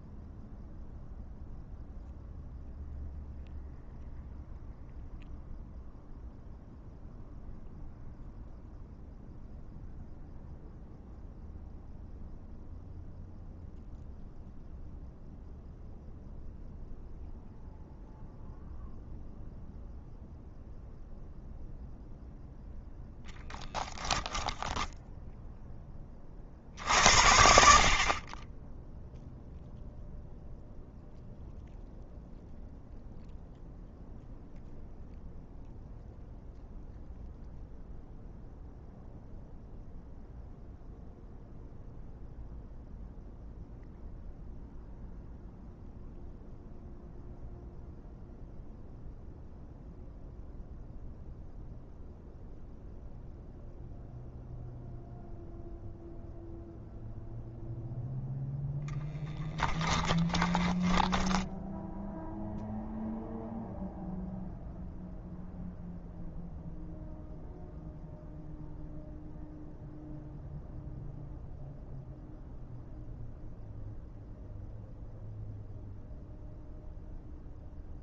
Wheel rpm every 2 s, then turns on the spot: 0, 0, 0, 0, 0, 0, 0, 0, 0, 0, 0, 0, 10, 60, 10, 0, 0, 0, 0, 0, 0, 0, 0, 0, 0, 0, 0, 0, 0, 0, 10, 0, 0, 0, 0, 0, 0, 0, 0.
60-62